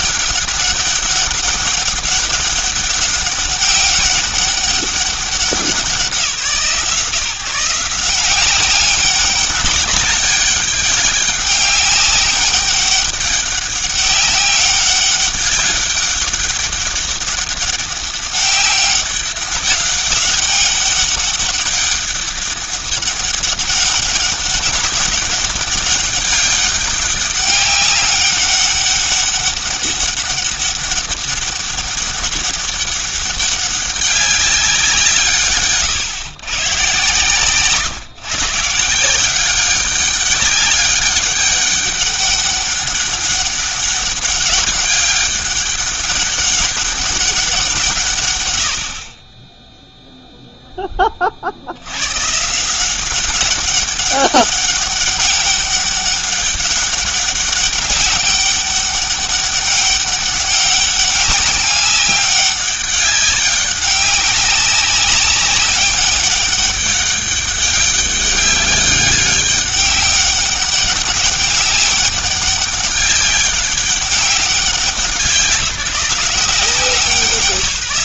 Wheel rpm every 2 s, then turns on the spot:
200, 200, 200, 150, 200, 200, 200, 200, 200, 200, 200, 200, 200, 200, 200, 200, 200, 180, 140, 160, 200, 200, 200, 200, 80, 10, 170, 200, 200, 200, 200, 200, 190, 200, 200, 200, 200, 190, 190.
none